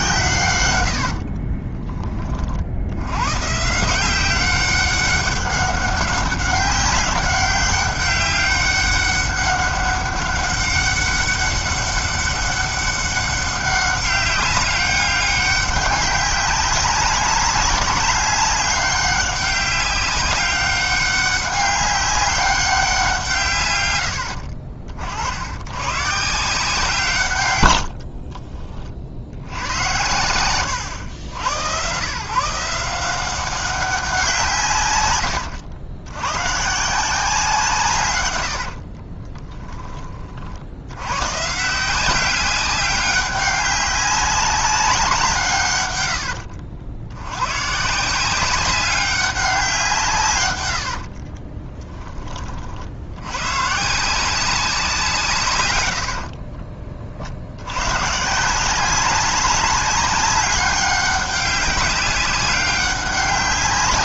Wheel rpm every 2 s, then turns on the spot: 110, 60, 190, 200, 200, 200, 200, 200, 200, 200, 190, 190, 60, 160, 20, 120, 170, 150, 140, 70, 60, 190, 190, 60, 190, 80, 40, 180, 40, 170, 190, 200.
0-2 38-40 50-52 56-58